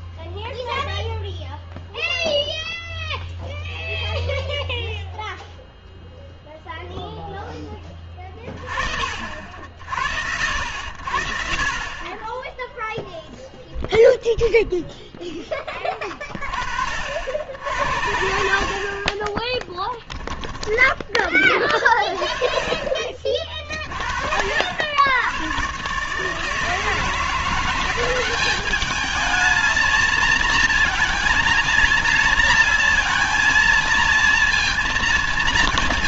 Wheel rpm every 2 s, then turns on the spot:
0, 0, 0, 0, 30, 60, 10, 0, 40, 50, 10, 30, 50, 150, 190, 230, 230, 230.
20-22